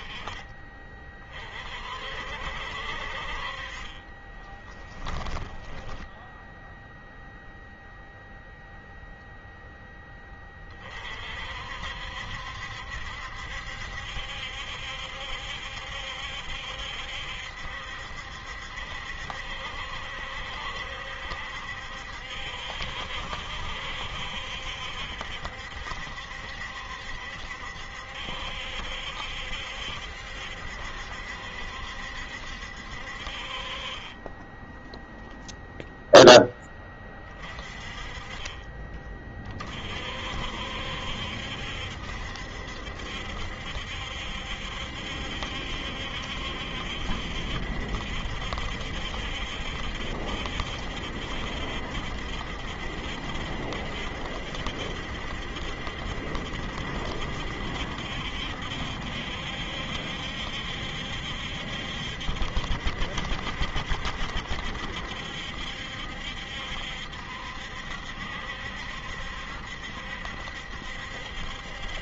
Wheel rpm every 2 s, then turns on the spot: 30, 60, 20, 0, 0, 30, 70, 70, 70, 70, 70, 60, 70, 70, 70, 70, 60, 10, 10, 30, 60, 70, 70, 70, 70, 70, 60, 70, 70, 70, 70, 70, 70, 70, 70, 70.
4-6